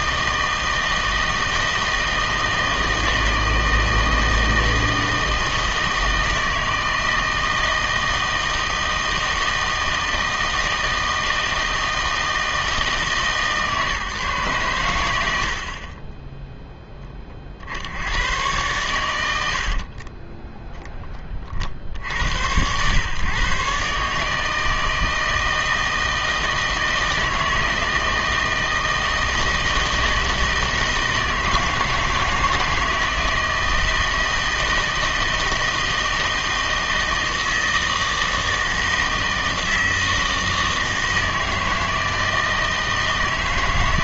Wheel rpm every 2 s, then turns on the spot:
160, 160, 160, 160, 160, 160, 160, 110, 0, 100, 0, 100, 160, 160, 160, 160, 160, 160, 160, 160, 160, 160.
none